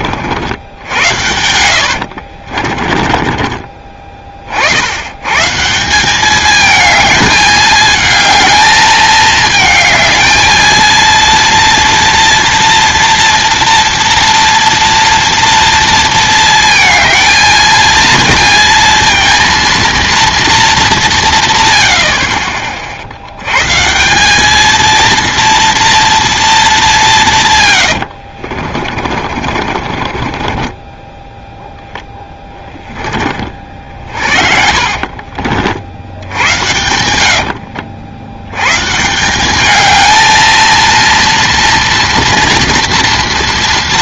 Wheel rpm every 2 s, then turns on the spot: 80, 30, 70, 220, 220, 230, 230, 230, 230, 230, 220, 50, 220, 210, 50, 20, 10, 50, 100, 120, 230, 240.
0-4 28-32 34-36